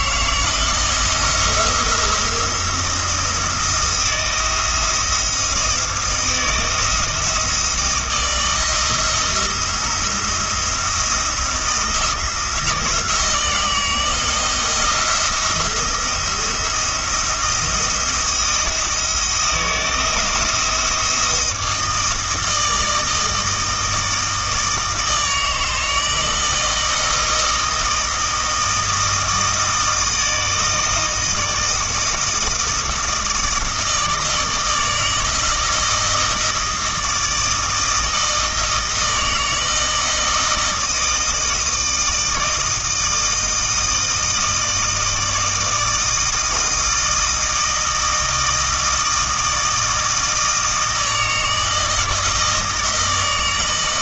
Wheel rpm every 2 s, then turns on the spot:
170, 170, 170, 160, 170, 170, 170, 170, 170, 170, 170, 160, 160, 160, 160, 160, 160, 160, 160, 160, 160, 160, 160, 160, 160, 160, 160.
none